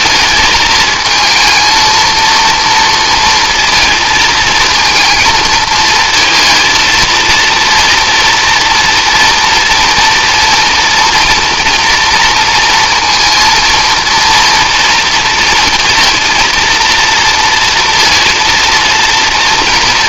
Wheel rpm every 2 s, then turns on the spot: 220, 230, 230, 220, 230, 230, 230, 230, 230, 230.
none